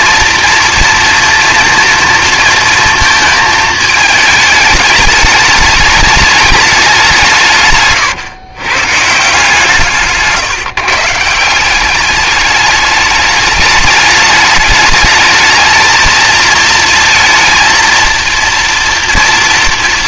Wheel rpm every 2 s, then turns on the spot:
230, 230, 220, 190, 140, 150, 210, 210, 230, 230.
none